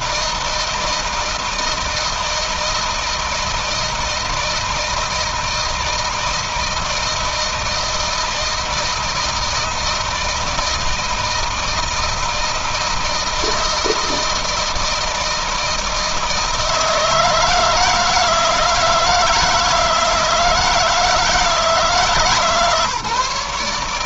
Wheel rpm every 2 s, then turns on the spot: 160, 160, 160, 160, 160, 160, 160, 160, 160, 160, 160, 150.
none